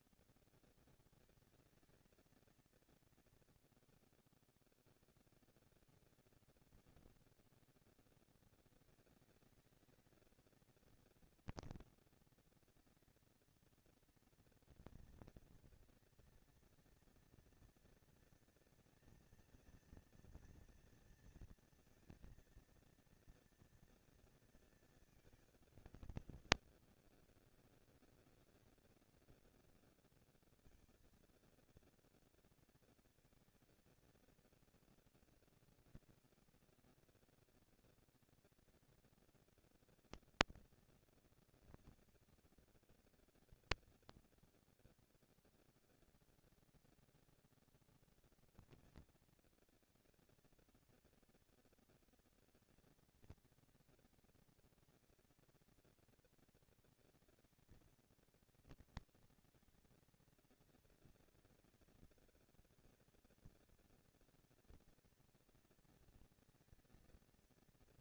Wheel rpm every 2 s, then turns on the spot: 150, 220, 90, 220, 230, 220, 230, 230, 230, 230, 230, 230, 230, 200, 200, 210, 230, 230, 230, 240, 230, 230, 240, 230, 230, 230, 230, 230, 230, 210, 190, 200, 230, 230.
none